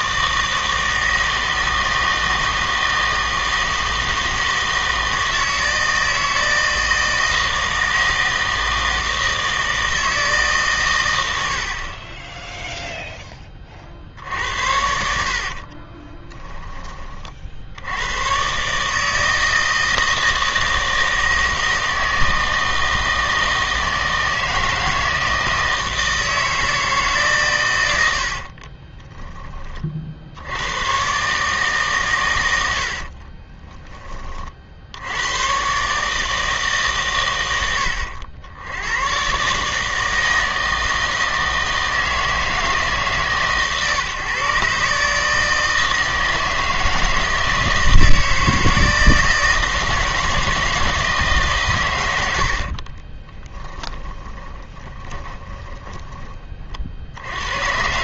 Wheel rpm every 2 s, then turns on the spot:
160, 160, 160, 160, 160, 130, 0, 70, 20, 140, 160, 160, 160, 160, 40, 90, 80, 60, 150, 100, 160, 150, 140, 160, 160, 160, 50, 20, 40.
14-16 28-30 52-56